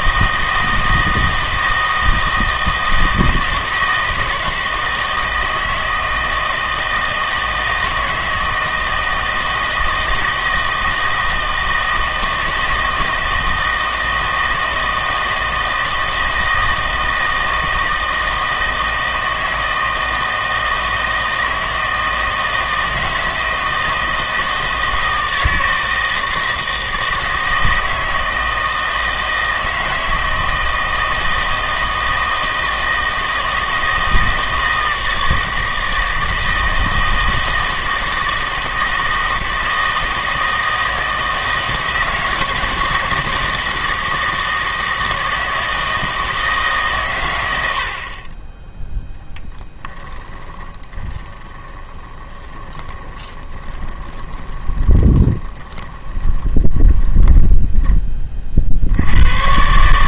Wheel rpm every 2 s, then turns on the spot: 160, 160, 160, 160, 160, 160, 160, 160, 160, 160, 160, 160, 160, 160, 160, 160, 160, 160, 160, 160, 160, 170, 160, 130, 0, 20, 20, 20, 20, 70.
50-58